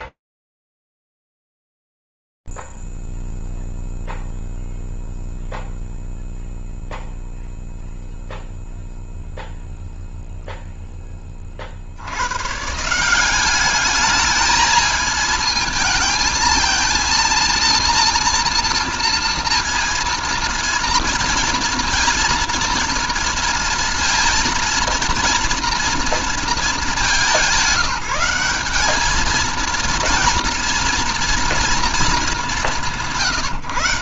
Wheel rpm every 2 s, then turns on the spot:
0, 0, 0, 0, 0, 0, 100, 210, 220, 230, 230, 240, 230, 230, 190, 230, 210.
none